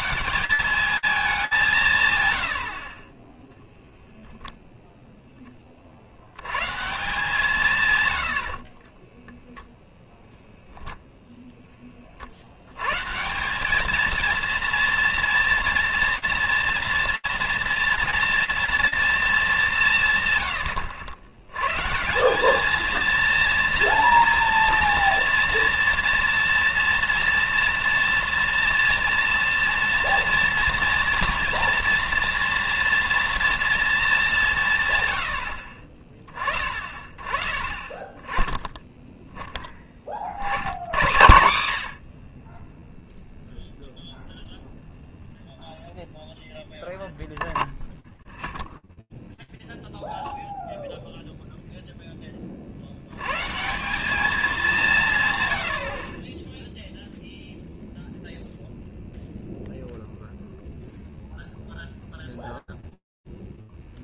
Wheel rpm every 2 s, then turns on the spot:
190, 10, 70, 120, 0, 40, 230, 230, 230, 150, 170, 230, 230, 230, 230, 240, 200, 20, 10, 50, 60, 0, 0, 0, 0, 10, 200, 40, 0, 0, 0, 10.
none